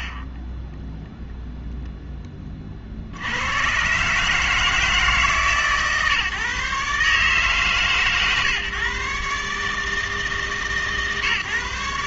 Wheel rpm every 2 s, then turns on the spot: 30, 30, 160, 150, 140, 150.
0-2